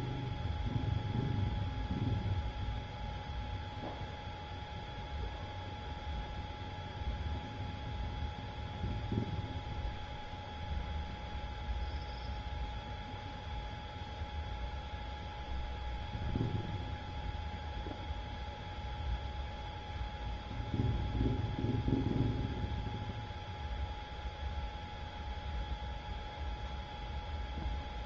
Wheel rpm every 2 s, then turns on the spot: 0, 0, 0, 0, 0, 0, 0, 0, 0, 0, 0, 0, 0, 0.
none